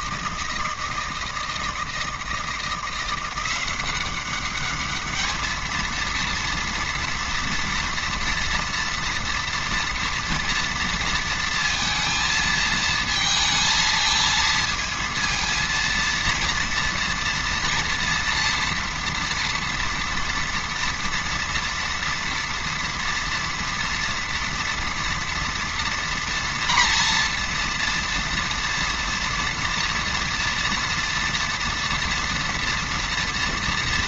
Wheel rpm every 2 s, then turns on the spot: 160, 170, 200, 230, 230, 230, 220, 220, 230, 230, 230, 230, 230, 230, 240, 230, 230.
none